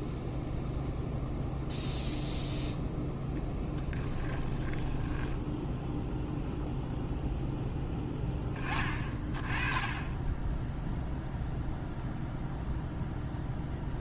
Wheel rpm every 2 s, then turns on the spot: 0, 0, 10, 0, 20, 0, 0.
4-6